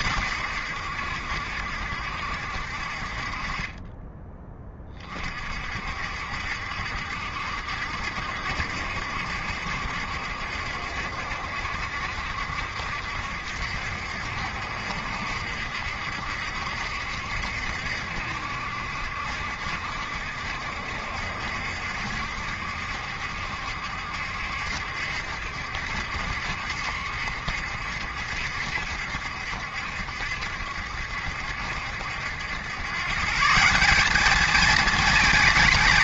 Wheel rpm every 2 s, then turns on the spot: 80, 60, 30, 60, 70, 70, 70, 70, 70, 70, 70, 70, 70, 70, 70, 70, 120, 220.
none